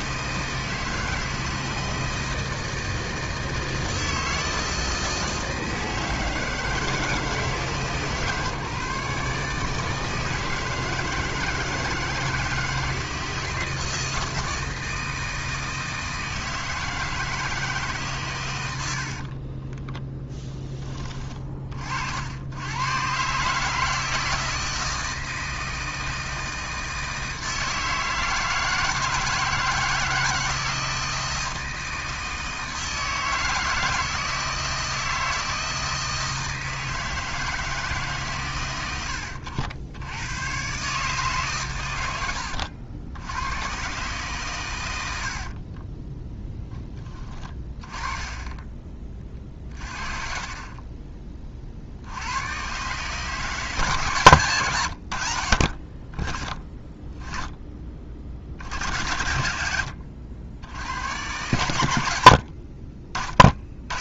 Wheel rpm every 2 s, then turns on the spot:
160, 160, 160, 160, 140, 160, 160, 160, 160, 90, 10, 110, 160, 160, 160, 170, 160, 160, 160, 110, 130, 80, 110, 10, 20, 30, 130, 100, 20, 80, 80, 40.
none